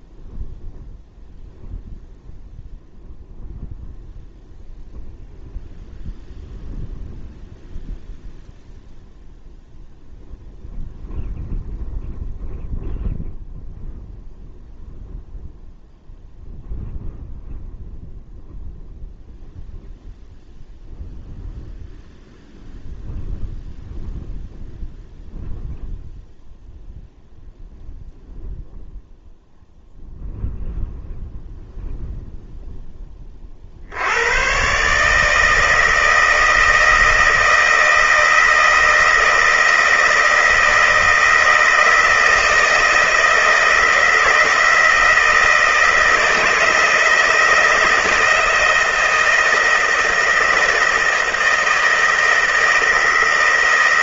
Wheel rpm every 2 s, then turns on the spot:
0, 0, 0, 0, 0, 0, 0, 0, 0, 0, 0, 0, 0, 0, 0, 0, 10, 130, 160, 160, 160, 160, 160, 160, 160, 160, 160.
none